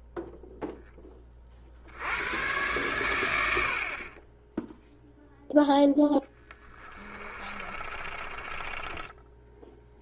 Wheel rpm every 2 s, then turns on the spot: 10, 100, 0, 30, 20.
6-10